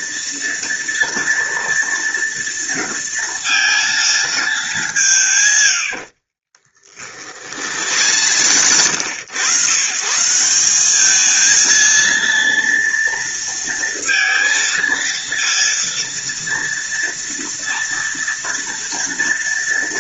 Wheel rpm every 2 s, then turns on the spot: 230, 230, 150, 50, 90, 220, 230, 230, 230, 230.
6-8